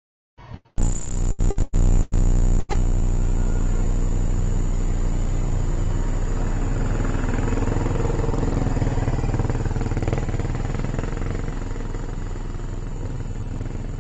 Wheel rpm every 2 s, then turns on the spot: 30, 0, 0, 0, 0, 0, 10.
none